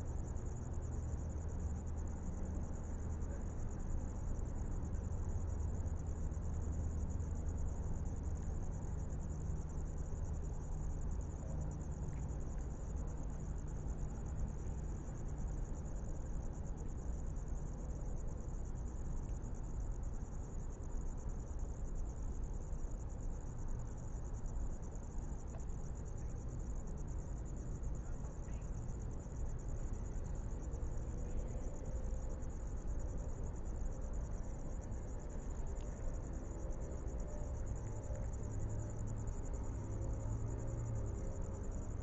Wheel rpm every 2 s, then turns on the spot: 0, 0, 0, 0, 0, 0, 0, 0, 0, 0, 0, 0, 0, 0, 0, 0, 0, 0, 0, 0, 0.
none